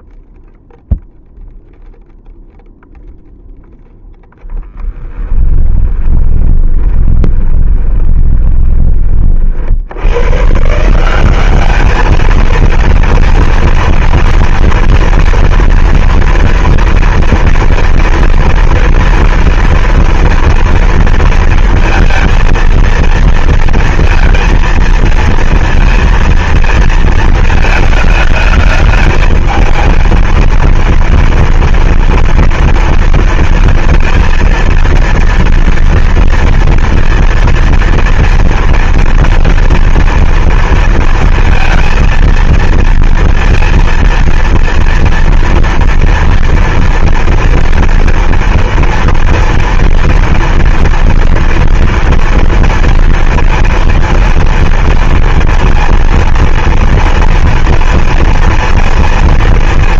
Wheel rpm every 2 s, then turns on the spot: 0, 0, 10, 20, 30, 170, 230, 230, 230, 230, 230, 230, 230, 230, 220, 230, 230, 230, 230, 230, 230, 230, 230, 230, 230, 240, 230, 230, 230, 230.
4-8